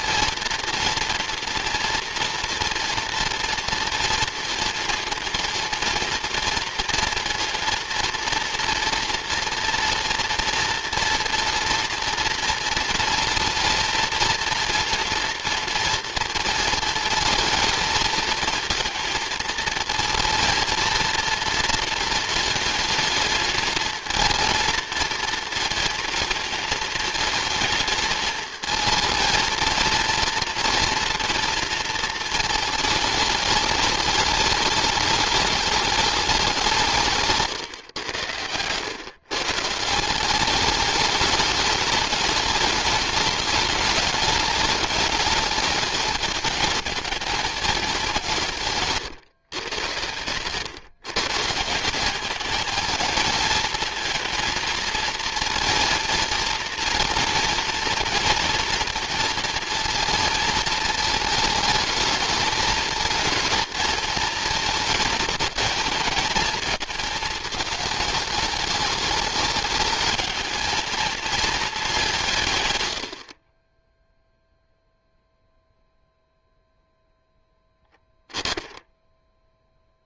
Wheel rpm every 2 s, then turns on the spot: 230, 230, 230, 230, 230, 230, 230, 230, 220, 230, 230, 220, 230, 220, 220, 230, 220, 210, 180, 110, 190, 200, 200, 220, 150, 130, 230, 230, 230, 230, 230, 220, 220, 220, 210, 230, 110, 0, 0, 10.
48-50